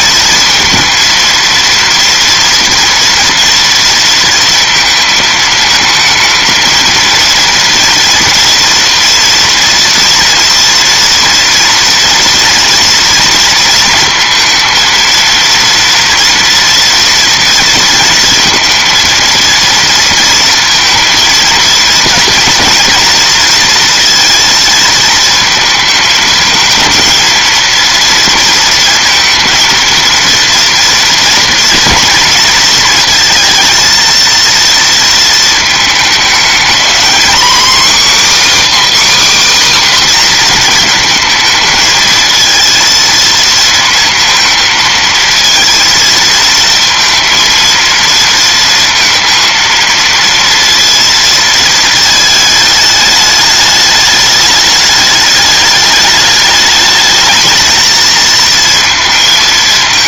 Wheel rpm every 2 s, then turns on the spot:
230, 230, 230, 230, 230, 230, 230, 230, 230, 230, 230, 230, 230, 220, 230, 230, 230, 230, 230, 300, 230, 230, 230, 230, 230, 230, 210, 210, 210, 230.
none